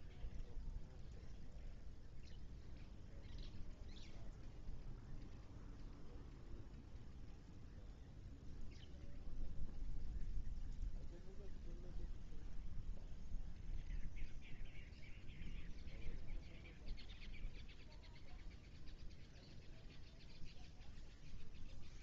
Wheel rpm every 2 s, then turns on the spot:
0, 0, 0, 0, 0, 0, 0, 0, 0, 0, 0.
none